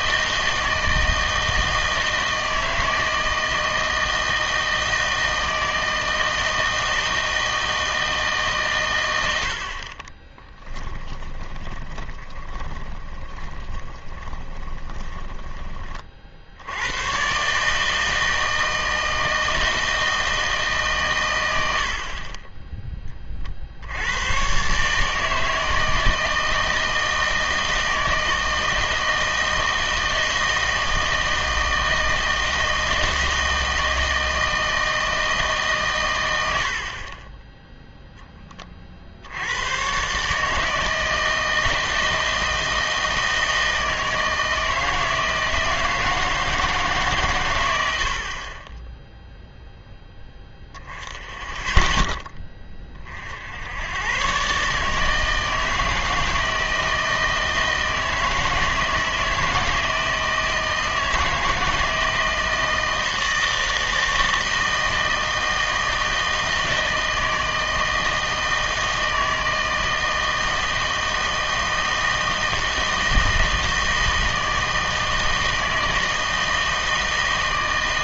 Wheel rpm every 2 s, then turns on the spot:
160, 160, 160, 160, 130, 10, 20, 20, 80, 160, 150, 20, 130, 160, 160, 160, 160, 160, 80, 30, 160, 160, 160, 160, 30, 10, 20, 140, 160, 160, 160, 160, 160, 160, 160, 160, 160, 160, 160.
10-16